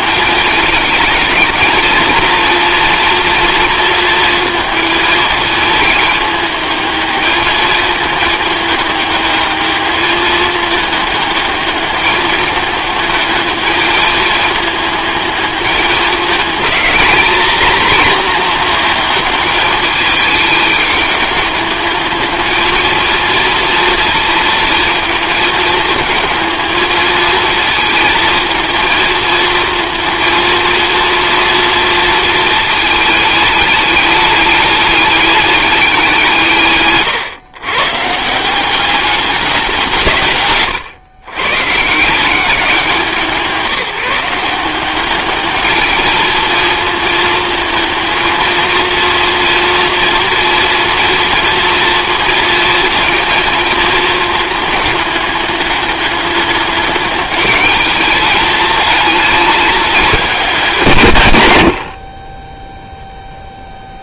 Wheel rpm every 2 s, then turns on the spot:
220, 230, 230, 220, 210, 210, 210, 220, 210, 230, 210, 220, 220, 220, 220, 230, 220, 210, 140, 190, 120, 180, 190, 220, 230, 230, 230, 210, 200, 220, 160, 0.
none